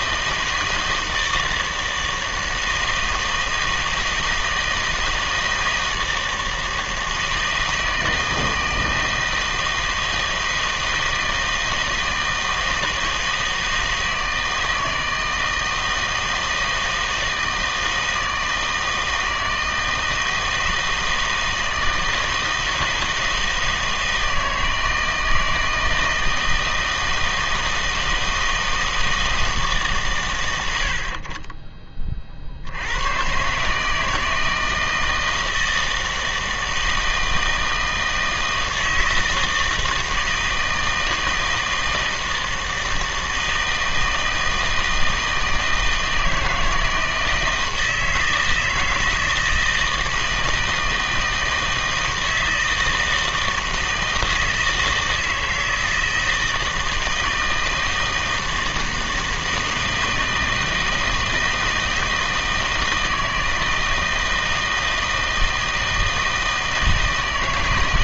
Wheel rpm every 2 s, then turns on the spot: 160, 160, 160, 160, 160, 160, 160, 160, 160, 160, 160, 160, 160, 160, 160, 90, 80, 160, 160, 160, 160, 160, 160, 160, 160, 160, 160, 160, 160, 160, 160, 160, 160, 160.
none